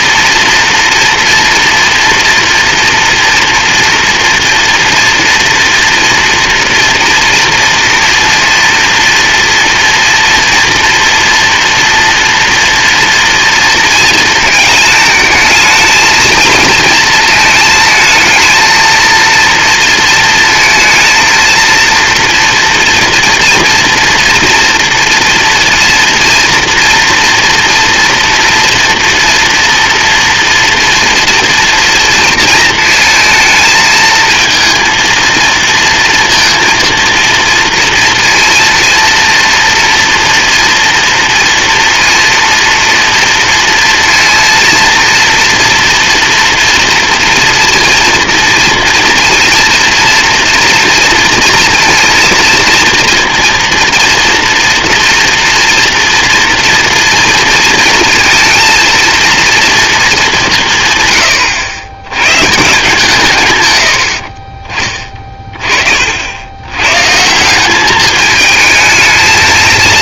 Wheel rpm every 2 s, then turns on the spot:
230, 230, 230, 230, 230, 240, 230, 220, 220, 230, 230, 240, 230, 240, 230, 230, 220, 230, 230, 240, 230, 230, 230, 230, 230, 230, 230, 230, 230, 230, 100, 140, 20, 160, 220.
none